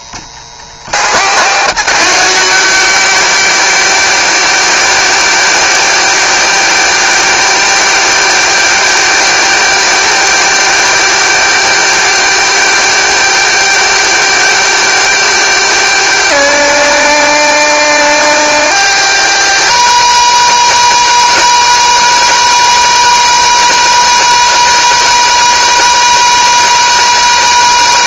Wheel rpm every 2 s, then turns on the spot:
240, 220, 220, 220, 220, 220, 220, 230, 220, 230, 220, 230, 220, 220.
none